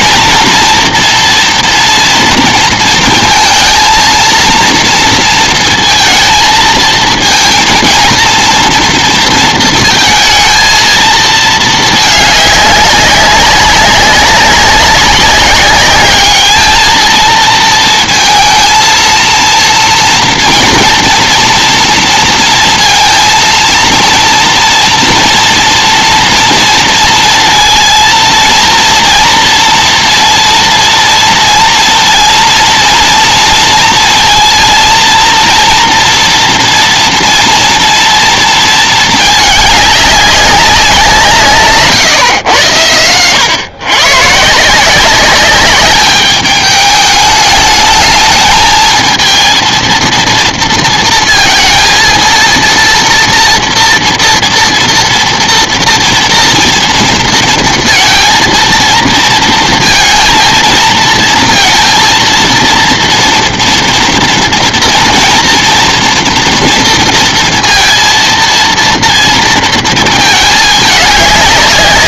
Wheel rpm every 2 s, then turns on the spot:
240, 230, 230, 230, 230, 220, 210, 190, 210, 230, 230, 230, 230, 230, 230, 230, 230, 230, 230, 230, 200, 140, 140, 200, 210, 230, 230, 230, 240, 230, 230, 230, 240, 240, 230, 220.
none